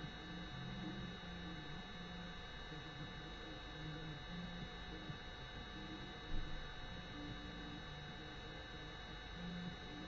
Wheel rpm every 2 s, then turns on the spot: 0, 0, 0, 0, 0.
none